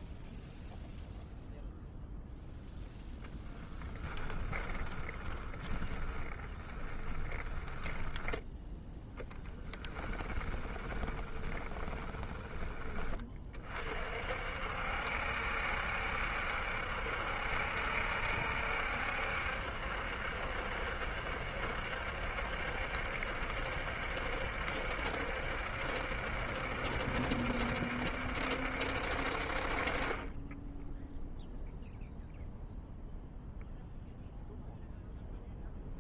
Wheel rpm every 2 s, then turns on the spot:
0, 0, 20, 20, 10, 20, 20, 60, 70, 70, 70, 70, 70, 70, 70, 20, 0, 0.
4-8 10-14